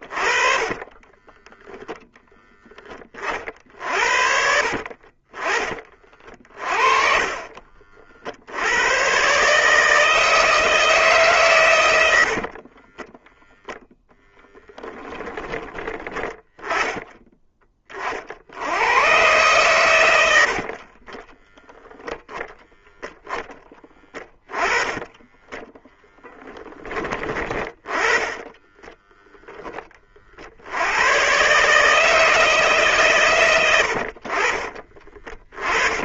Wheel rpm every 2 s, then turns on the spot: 20, 20, 50, 40, 110, 150, 20, 10, 10, 90, 30, 0, 20, 10, 10, 80, 140, 30.
0-2 4-6 12-14 20-22 24-26 28-30